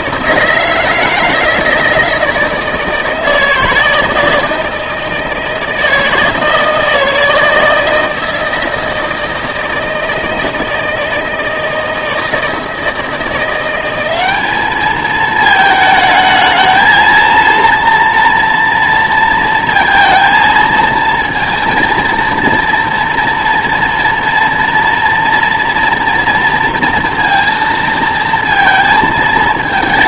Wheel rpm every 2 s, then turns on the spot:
160, 160, 160, 160, 160, 160, 160, 210, 220, 230, 230, 240, 230, 230, 230.
none